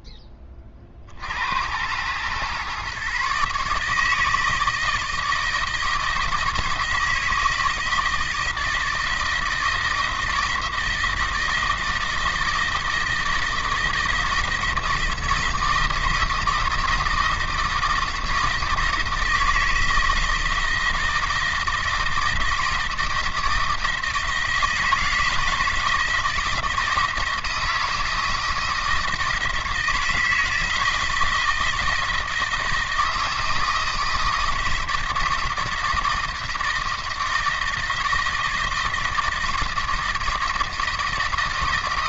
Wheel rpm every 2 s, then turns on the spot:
30, 130, 160, 160, 160, 160, 160, 160, 170, 160, 160, 160, 160, 160, 160, 160, 160, 160, 160, 160, 160.
none